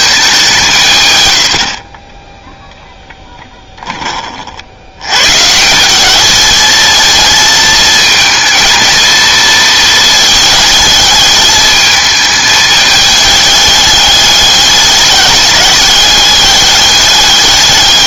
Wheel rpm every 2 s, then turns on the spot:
160, 10, 70, 220, 230, 220, 220, 200, 200.
2-4